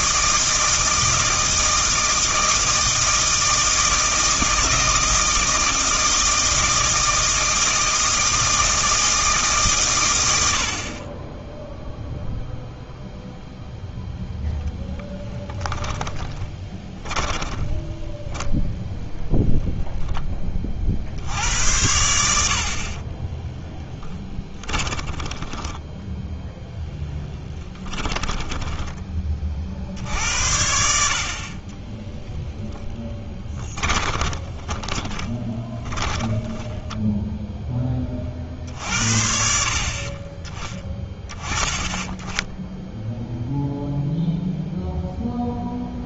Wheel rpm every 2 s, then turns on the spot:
160, 160, 160, 160, 160, 70, 0, 0, 10, 0, 30, 60, 30, 0, 10, 70, 10, 20, 10, 50, 20, 10, 0.
16-18 24-26 28-30 34-38